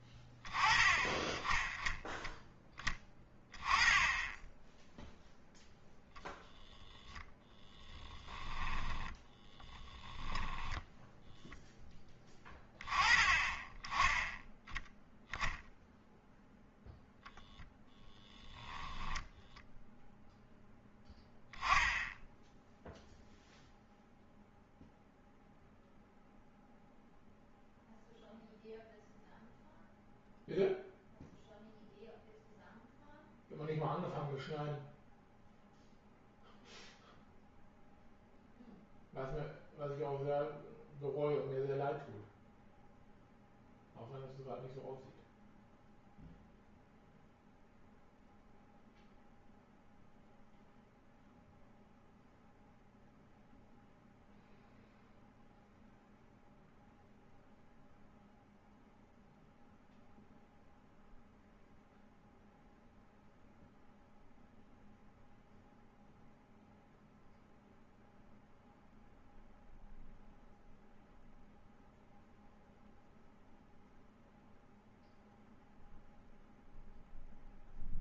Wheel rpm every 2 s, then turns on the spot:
20, 10, 0, 10, 20, 0, 20, 0, 0, 0, 0, 0, 0, 0, 0, 0, 0, 0, 0, 0, 0, 0, 0, 0, 0, 0, 0, 0, 0, 0, 0, 0, 0, 0, 0, 0, 0, 0, 0.
6-10